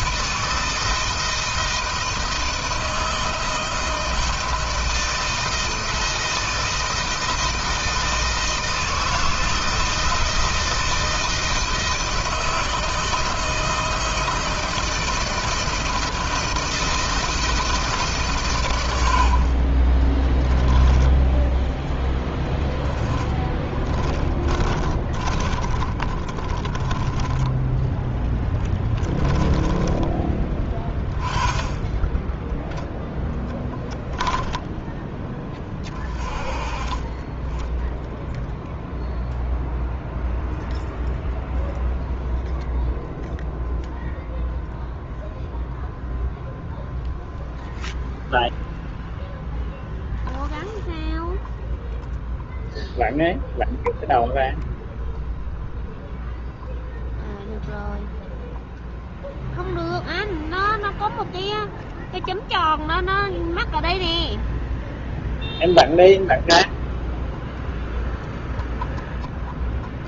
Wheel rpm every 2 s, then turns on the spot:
160, 160, 160, 160, 160, 160, 160, 160, 160, 120, 10, 30, 30, 30, 10, 20, 10, 10, 30, 0, 0, 0, 0, 0, 0, 0, 0, 0, 0, 0, 0, 0, 0, 0, 0.
22-26 28-30